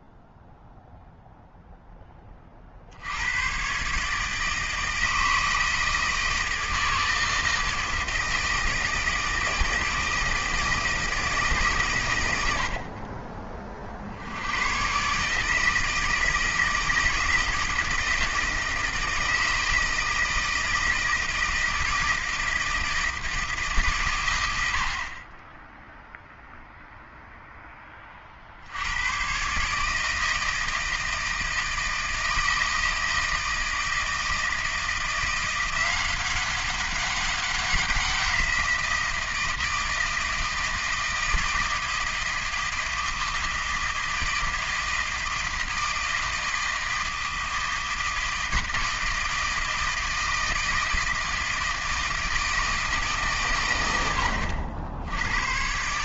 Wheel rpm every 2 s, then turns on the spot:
0, 20, 150, 160, 160, 160, 110, 80, 160, 160, 160, 160, 80, 0, 80, 160, 160, 160, 190, 180, 160, 160, 160, 160, 160, 160, 160, 80.
none